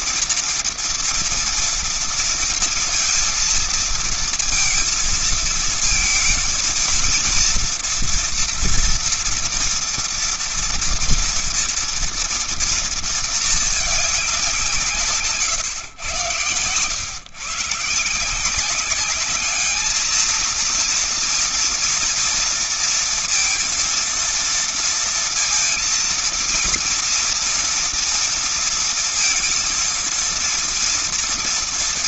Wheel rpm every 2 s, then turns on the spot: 230, 230, 220, 230, 230, 230, 230, 180, 120, 180, 230, 230, 230, 230, 230, 230.
none